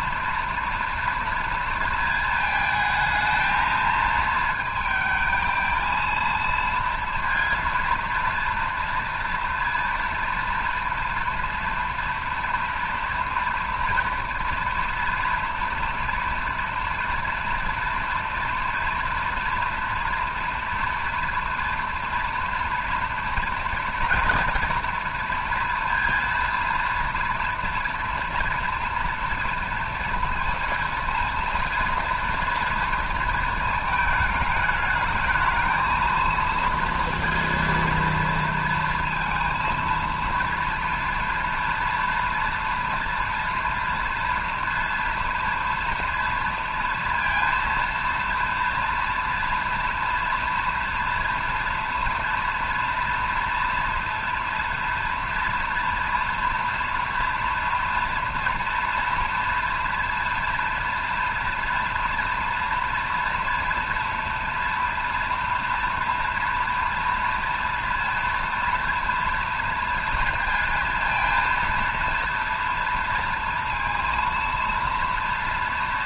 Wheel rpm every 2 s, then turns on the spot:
230, 220, 220, 230, 230, 230, 240, 230, 240, 230, 230, 230, 240, 230, 230, 230, 230, 220, 230, 230, 230, 230, 240, 230, 230, 230, 230, 230, 230, 230, 230, 230, 230, 230, 230, 220, 230, 230.
none